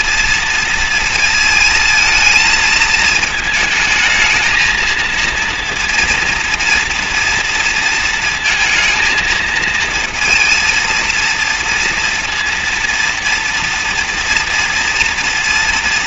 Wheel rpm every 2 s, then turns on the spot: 230, 220, 220, 230, 230, 230, 230, 240.
none